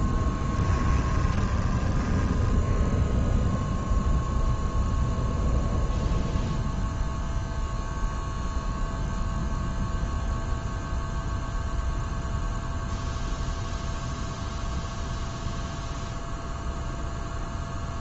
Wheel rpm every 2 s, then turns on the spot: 20, 0, 0, 0, 0, 0, 0, 0, 0.
0-2